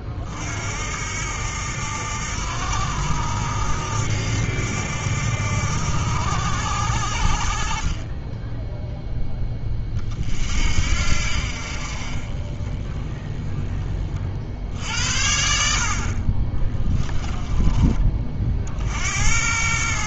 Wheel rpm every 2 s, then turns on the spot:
60, 80, 80, 70, 0, 60, 20, 60, 20, 60.
16-18